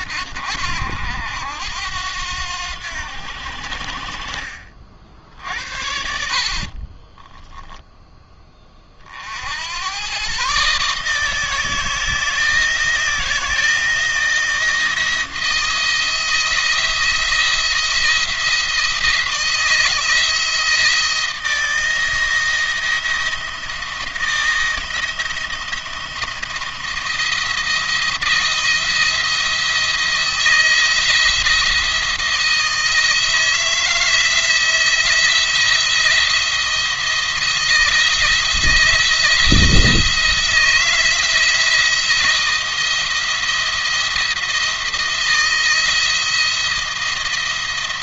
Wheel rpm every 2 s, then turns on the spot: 80, 90, 50, 50, 20, 140, 160, 160, 160, 170, 170, 170, 170, 170, 170, 170, 160, 160, 170, 170, 170, 170, 170, 170.
6-8